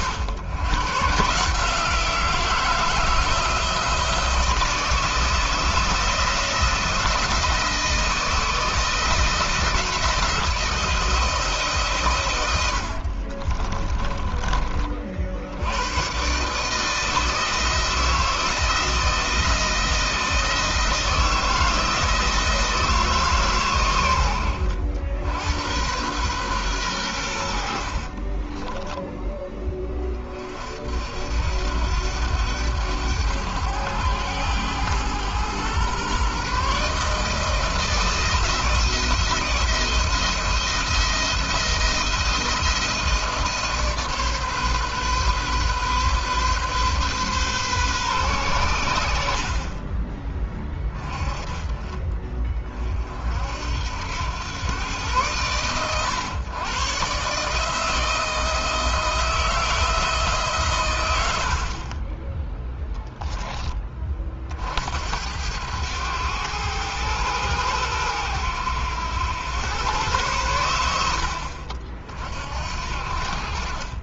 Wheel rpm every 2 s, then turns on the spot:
130, 160, 160, 170, 160, 170, 80, 30, 150, 160, 170, 160, 80, 110, 20, 50, 100, 110, 140, 160, 170, 170, 140, 130, 100, 20, 40, 100, 120, 160, 140, 10, 50, 110, 100, 90, 50.
12-14 28-30